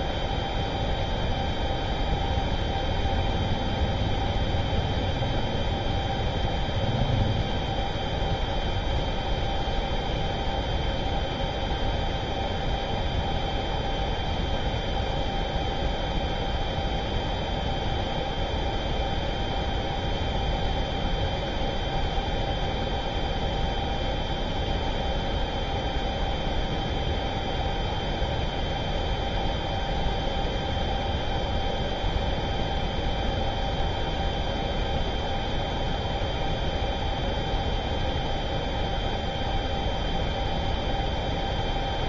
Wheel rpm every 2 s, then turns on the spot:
0, 0, 0, 0, 0, 0, 0, 0, 0, 0, 0, 0, 0, 0, 0, 0, 0, 0, 0, 0, 0.
none